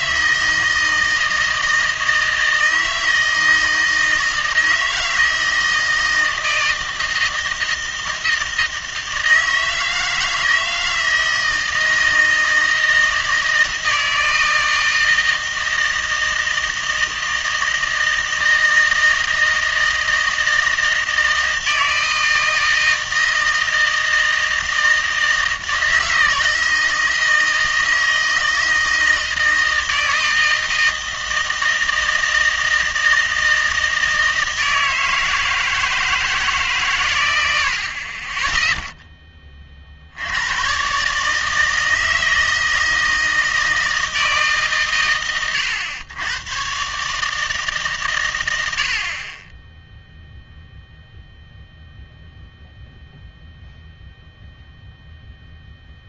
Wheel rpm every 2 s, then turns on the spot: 160, 160, 160, 160, 160, 160, 160, 160, 160, 160, 160, 160, 160, 160, 160, 160, 160, 160, 140, 0, 110, 160, 140, 120, 90, 0, 0, 0.
none